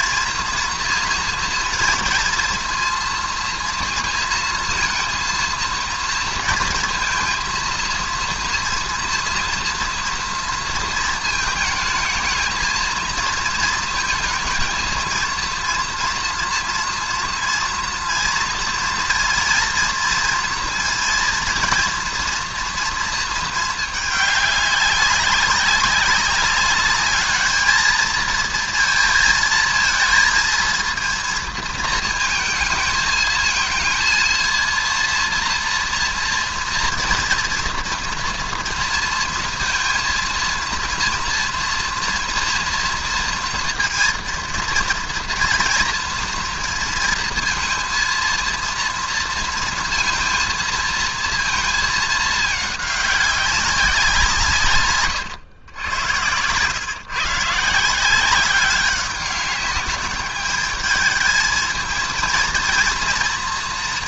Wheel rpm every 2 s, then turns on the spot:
230, 230, 230, 230, 230, 240, 220, 220, 230, 230, 230, 230, 200, 200, 230, 230, 220, 230, 230, 230, 230, 230, 230, 230, 230, 230, 210, 170, 120, 190, 210, 230.
none